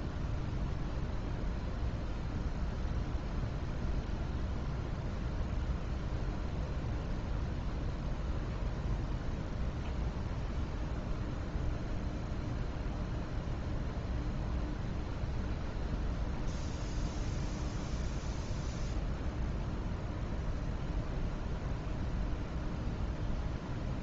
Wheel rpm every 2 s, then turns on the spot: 0, 0, 0, 0, 0, 0, 0, 0, 0, 0, 0, 0.
none